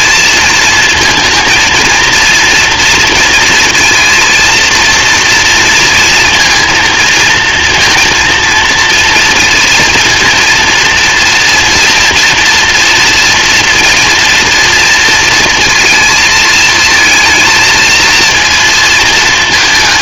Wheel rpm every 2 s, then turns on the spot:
230, 230, 230, 230, 240, 230, 230, 230, 230, 220.
none